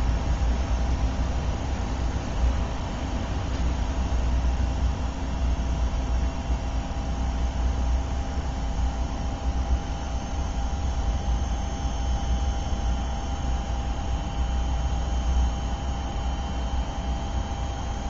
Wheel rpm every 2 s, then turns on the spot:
0, 0, 0, 0, 0, 0, 0, 0, 0.
none